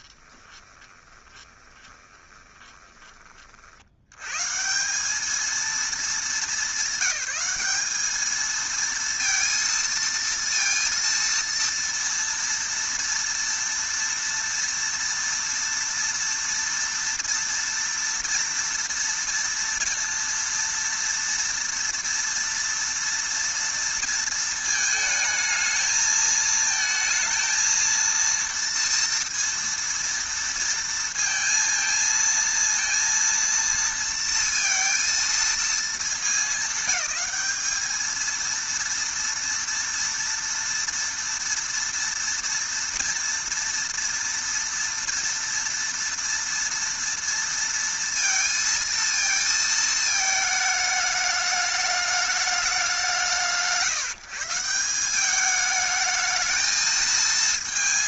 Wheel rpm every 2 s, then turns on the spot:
20, 20, 150, 200, 220, 230, 230, 230, 230, 230, 230, 230, 220, 220, 230, 230, 230, 230, 200, 230, 230, 230, 230, 230, 230, 220, 210, 170, 220.
0-4